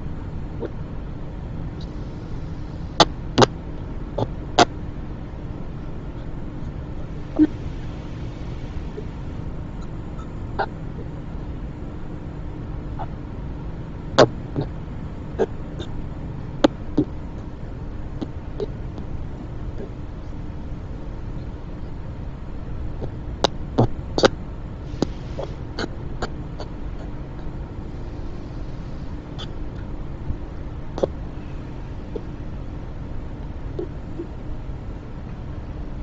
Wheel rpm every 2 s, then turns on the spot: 0, 0, 0, 0, 0, 0, 0, 0, 0, 0, 0, 0, 0, 0, 0, 0, 0, 0.
none